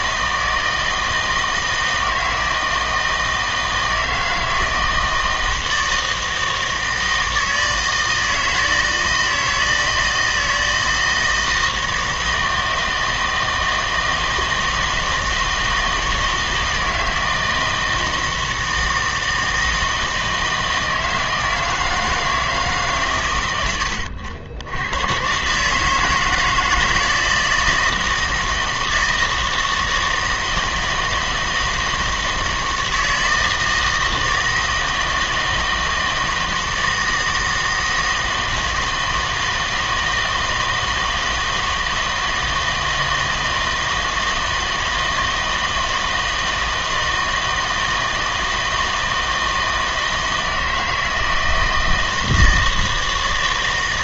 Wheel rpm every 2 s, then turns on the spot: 160, 160, 160, 160, 160, 160, 160, 160, 160, 160, 160, 160, 80, 160, 160, 160, 160, 160, 160, 160, 160, 160, 160, 160, 160, 160, 160.
none